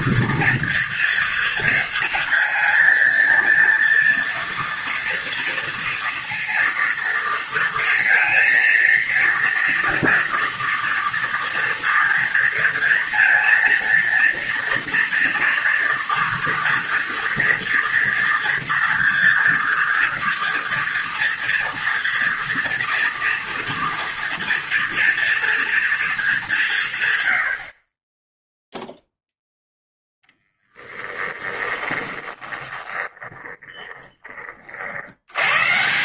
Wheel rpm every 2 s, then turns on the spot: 230, 230, 230, 230, 230, 230, 230, 230, 230, 230, 230, 230, 240, 200, 10, 10, 20, 30.
30-34